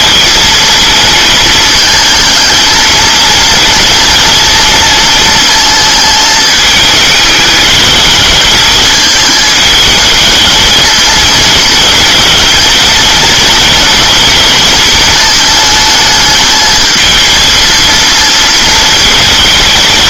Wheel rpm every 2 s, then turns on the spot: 230, 220, 230, 220, 220, 220, 230, 230, 220, 220.
none